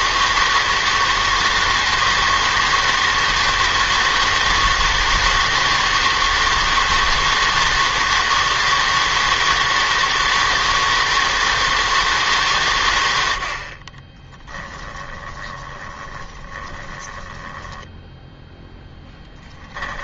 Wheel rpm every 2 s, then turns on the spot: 160, 160, 160, 160, 160, 160, 110, 10, 20, 10.
14-18